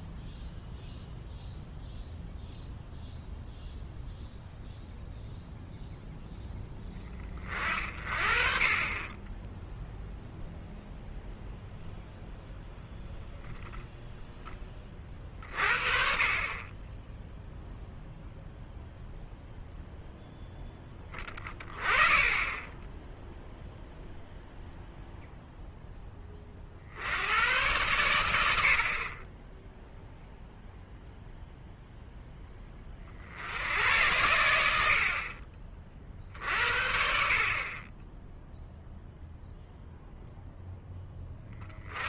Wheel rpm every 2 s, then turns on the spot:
0, 0, 0, 10, 20, 0, 0, 20, 20, 0, 10, 10, 0, 70, 50, 0, 20, 60, 50, 0, 10.
none